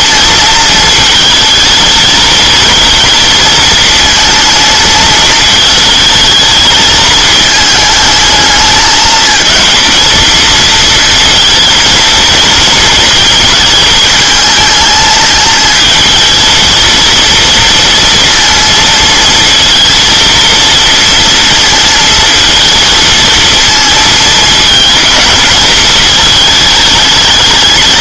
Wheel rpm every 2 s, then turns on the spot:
220, 230, 220, 220, 220, 220, 230, 220, 230, 230, 230, 230, 220, 210.
none